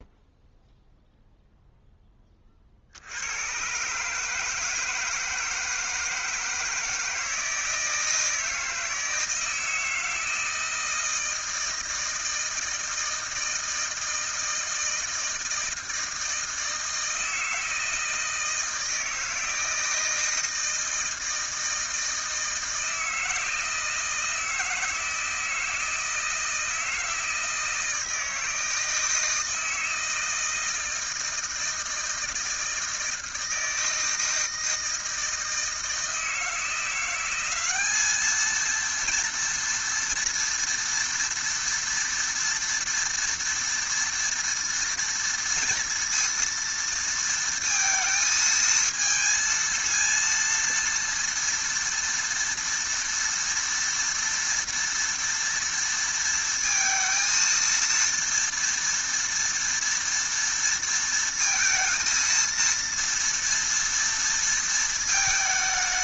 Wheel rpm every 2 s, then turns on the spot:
0, 30, 150, 160, 160, 160, 160, 160, 160, 160, 160, 160, 160, 160, 160, 160, 160, 160, 170, 230, 230, 230, 230, 230, 220, 230, 230, 230, 230, 230, 230, 230, 230.
none